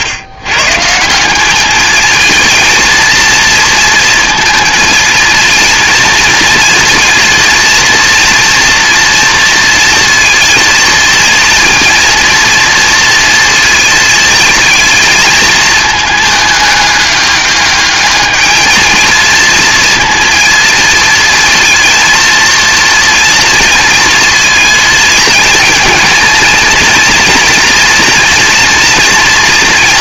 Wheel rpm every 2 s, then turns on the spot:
160, 230, 230, 230, 240, 230, 230, 230, 210, 220, 230, 230, 230, 230, 230.
none